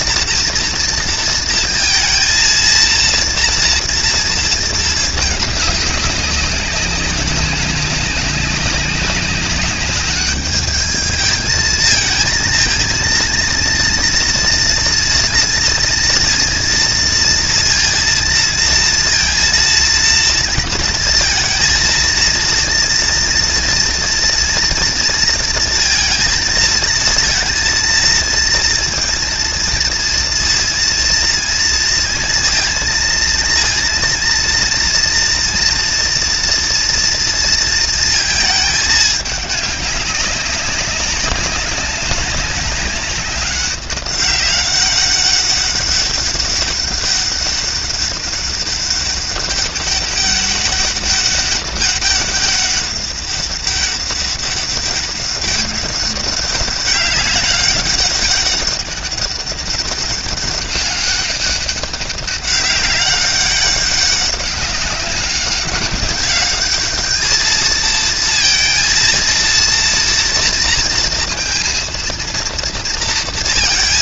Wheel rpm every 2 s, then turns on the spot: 230, 230, 230, 200, 190, 210, 220, 230, 230, 230, 230, 230, 230, 230, 230, 230, 230, 230, 230, 220, 190, 200, 200, 200, 200, 200, 200, 200, 200, 200, 200, 200, 200, 200, 230, 230, 230.
none